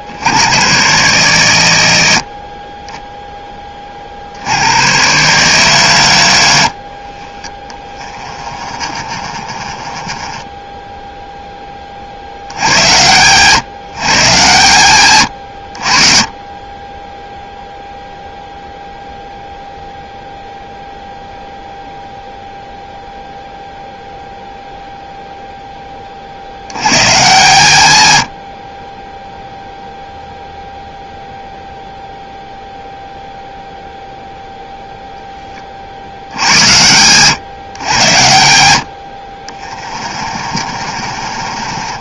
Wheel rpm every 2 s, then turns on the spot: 100, 40, 80, 80, 30, 10, 80, 130, 20, 0, 0, 0, 0, 80, 60, 0, 0, 0, 80, 90, 40.
6-12 40-42